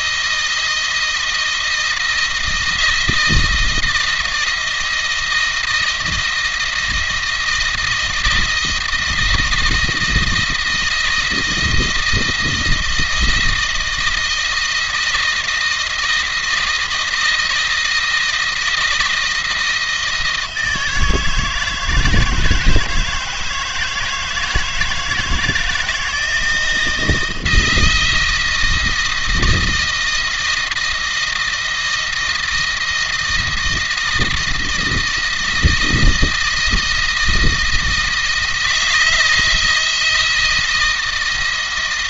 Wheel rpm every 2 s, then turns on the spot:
160, 160, 160, 160, 160, 160, 170, 170, 160, 160, 160, 160, 160, 160, 160, 160, 170, 160, 160, 160, 160.
none